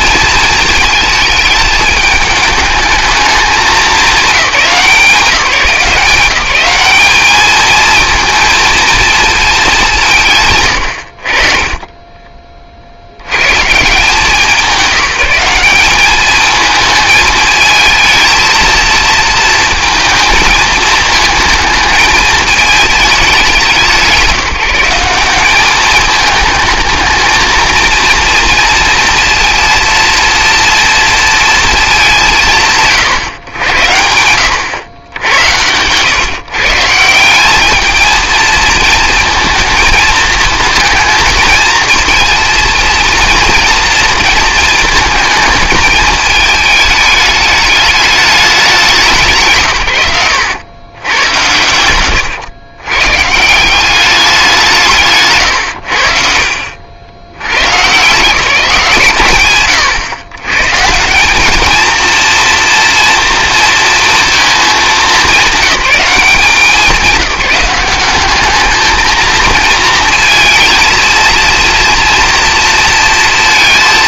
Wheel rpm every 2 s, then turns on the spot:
230, 210, 200, 190, 230, 140, 30, 180, 220, 220, 220, 220, 170, 210, 230, 230, 100, 100, 140, 220, 220, 230, 220, 220, 200, 100, 110, 180, 60, 160, 130, 230, 220, 200, 210, 230, 230.
none